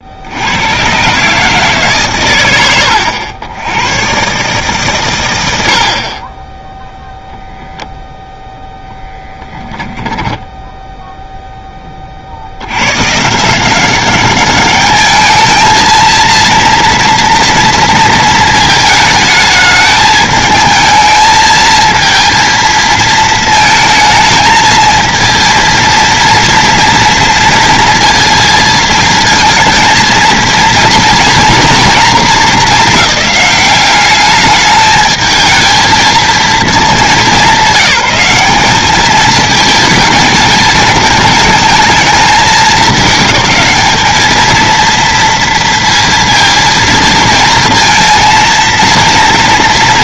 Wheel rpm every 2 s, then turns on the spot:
100, 80, 140, 0, 10, 10, 90, 200, 230, 220, 220, 230, 220, 230, 220, 230, 200, 210, 220, 200, 220, 210, 230, 220, 230.
10-12